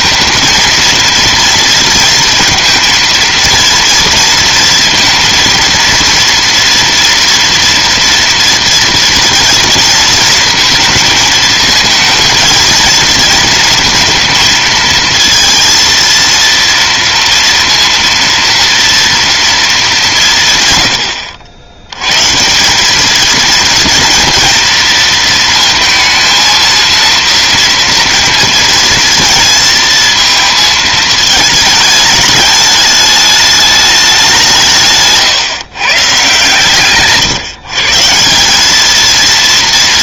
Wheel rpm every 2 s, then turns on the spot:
230, 230, 230, 230, 240, 230, 220, 230, 230, 230, 140, 160, 230, 230, 230, 220, 210, 180, 140, 180.
none